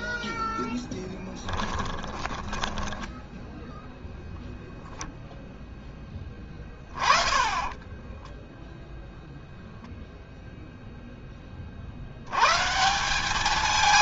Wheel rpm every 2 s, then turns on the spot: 10, 10, 0, 20, 0, 0, 160.
0-4